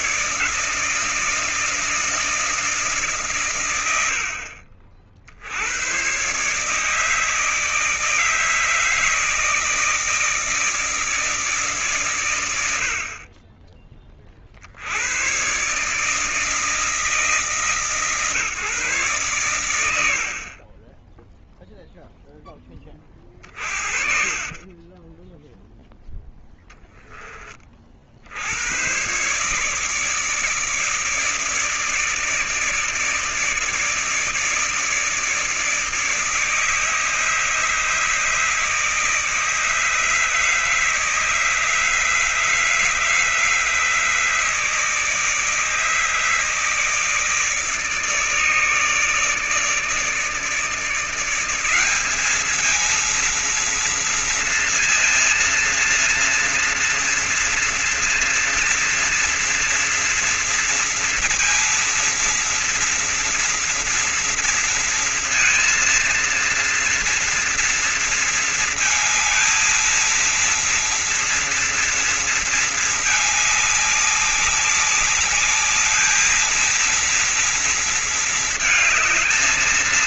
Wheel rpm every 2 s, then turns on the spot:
150, 150, 60, 150, 160, 160, 60, 100, 160, 130, 20, 30, 10, 30, 140, 150, 160, 160, 150, 150, 160, 160, 160, 150, 150, 190, 230, 230, 230, 230, 230, 230, 230, 230, 230, 230, 210, 210, 230, 220.
22-26